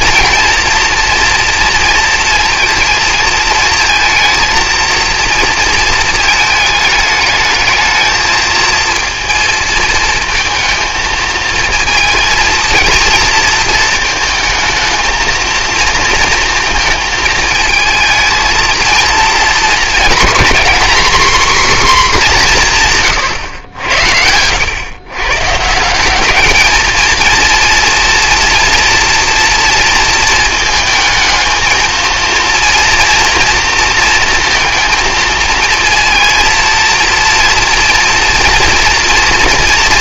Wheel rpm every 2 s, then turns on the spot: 230, 230, 230, 220, 220, 230, 230, 220, 230, 220, 240, 190, 100, 210, 230, 220, 230, 230, 230, 230.
none